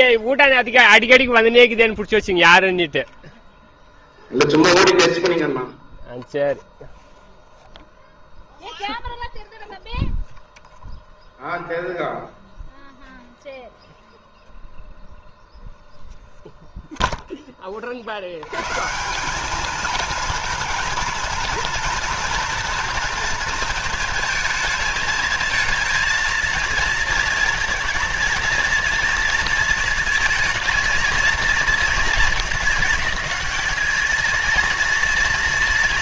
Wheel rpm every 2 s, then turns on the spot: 0, 0, 0, 0, 0, 0, 0, 0, 0, 120, 230, 230, 220, 220, 230, 230, 210, 230.
none